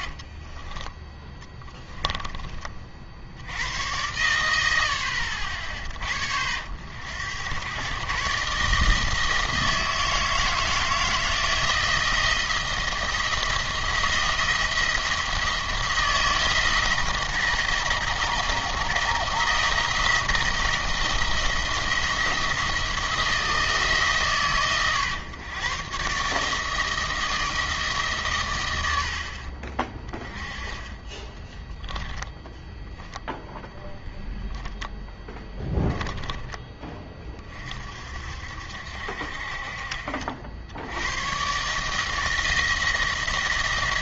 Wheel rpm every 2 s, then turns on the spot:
30, 40, 90, 70, 150, 160, 170, 170, 160, 170, 170, 170, 130, 160, 100, 30, 10, 10, 10, 60, 80, 160.
0-2 32-36